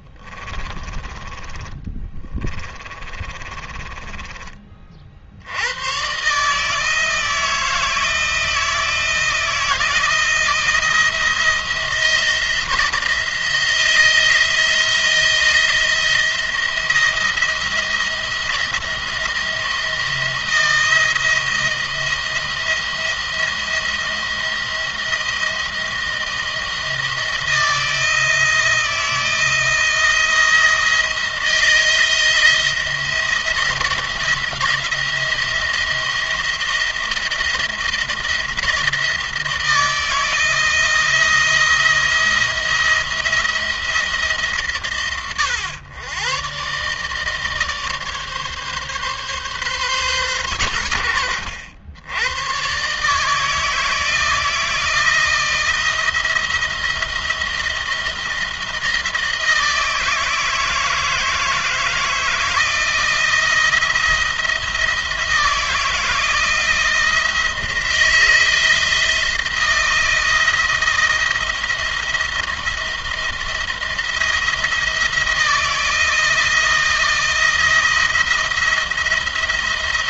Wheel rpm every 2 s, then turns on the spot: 20, 20, 30, 150, 170, 170, 160, 170, 170, 170, 170, 170, 170, 160, 160, 170, 170, 170, 170, 160, 170, 170, 140, 130, 140, 110, 120, 160, 170, 170, 160, 160, 170, 170, 170, 170, 170, 170, 170, 170.
0-4